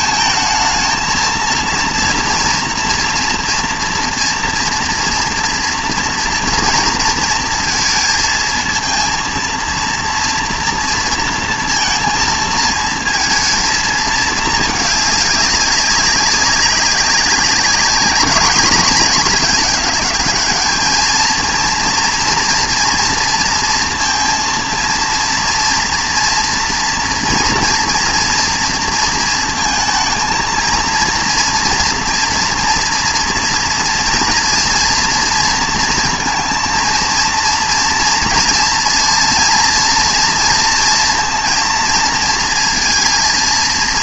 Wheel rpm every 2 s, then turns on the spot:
220, 240, 240, 230, 220, 230, 220, 210, 190, 210, 220, 230, 230, 230, 230, 230, 240, 230, 230, 230, 230, 230.
none